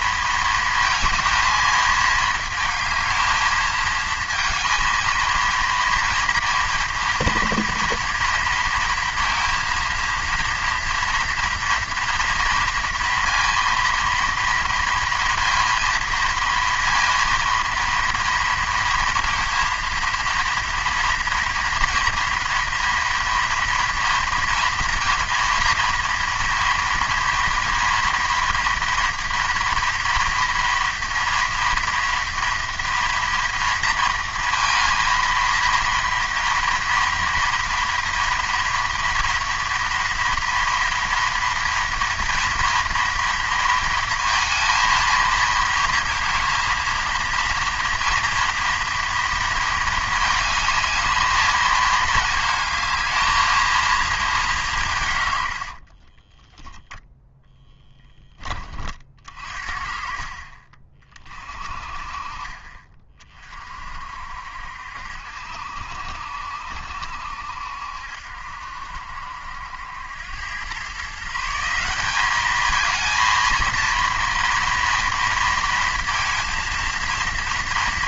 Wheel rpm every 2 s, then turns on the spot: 230, 220, 220, 230, 230, 230, 230, 230, 230, 230, 230, 230, 240, 230, 230, 230, 230, 230, 230, 230, 230, 230, 230, 230, 230, 220, 220, 180, 10, 30, 30, 30, 70, 70, 70, 110, 210, 230, 230.
56-58